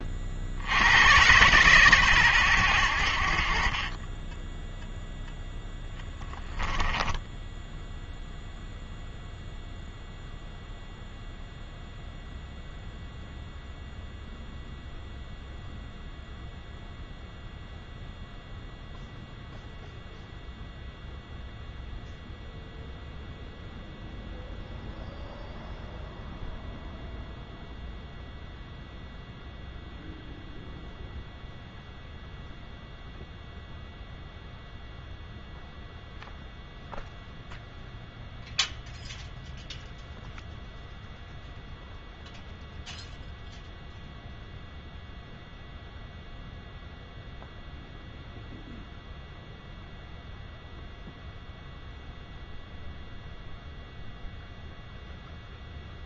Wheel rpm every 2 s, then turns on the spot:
80, 80, 0, 10, 0, 0, 0, 0, 0, 0, 0, 0, 0, 0, 0, 0, 0, 0, 0, 0, 0, 0, 0, 0, 0, 0, 0, 0.
6-8